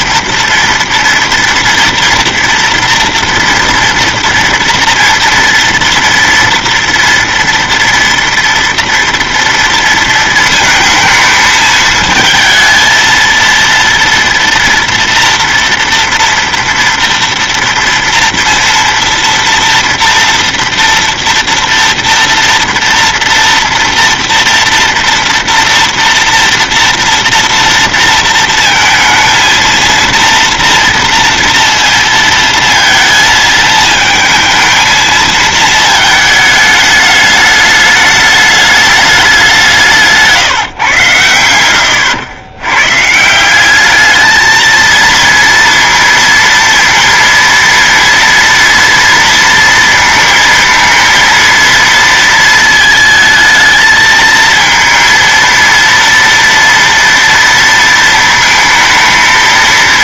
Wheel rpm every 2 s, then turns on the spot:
230, 230, 230, 230, 230, 230, 230, 230, 230, 230, 240, 240, 230, 230, 230, 230, 230, 220, 210, 210, 150, 110, 220, 230, 230, 230, 230, 220, 230, 220.
none